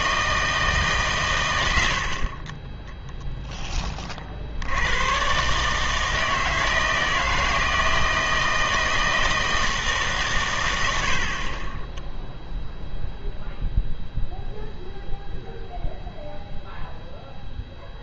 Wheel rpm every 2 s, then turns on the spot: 150, 10, 90, 160, 160, 100, 0, 0, 0.
none